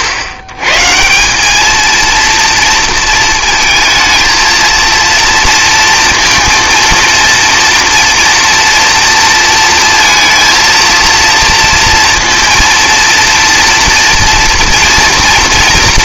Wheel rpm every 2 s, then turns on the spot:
100, 230, 230, 230, 240, 230, 230, 230.
none